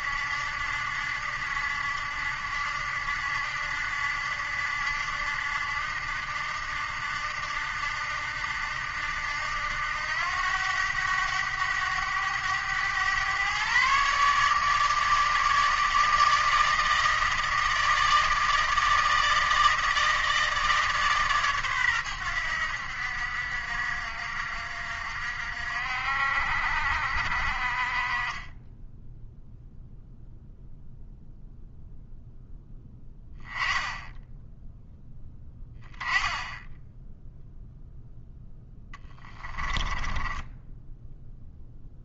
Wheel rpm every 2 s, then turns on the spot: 70, 70, 80, 80, 80, 90, 110, 150, 160, 160, 150, 80, 60, 50, 10, 0, 10, 10, 10, 10, 10.
28-30 38-40